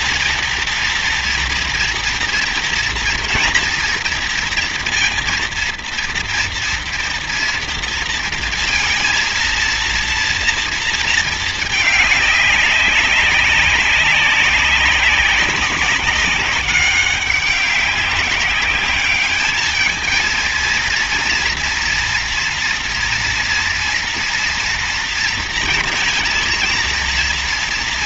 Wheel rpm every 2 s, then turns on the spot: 230, 230, 230, 230, 230, 230, 200, 190, 190, 200, 230, 230, 230, 230.
none